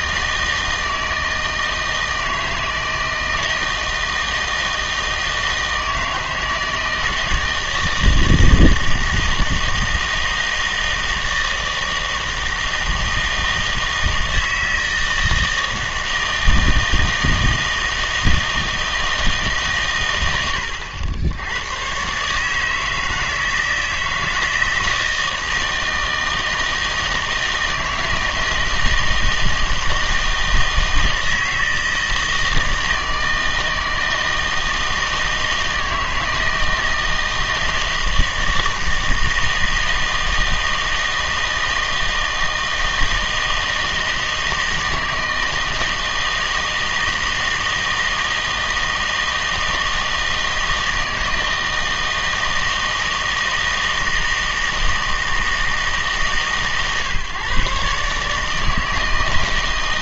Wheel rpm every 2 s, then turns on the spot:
160, 160, 160, 160, 160, 160, 160, 160, 160, 160, 90, 160, 160, 160, 160, 160, 160, 160, 160, 160, 160, 160, 160, 160, 160, 160, 160, 160, 140, 160.
none